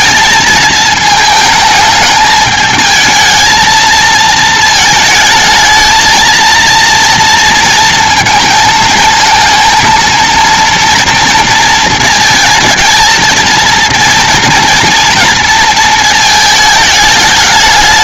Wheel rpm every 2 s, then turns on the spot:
220, 220, 220, 230, 220, 230, 220, 240, 220.
none